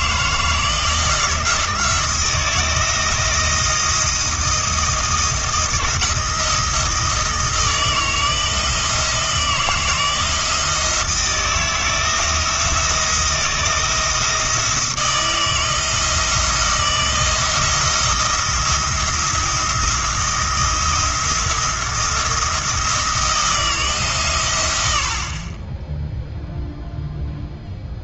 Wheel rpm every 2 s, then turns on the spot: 160, 170, 160, 160, 160, 160, 170, 170, 170, 170, 170, 170, 100, 0.
none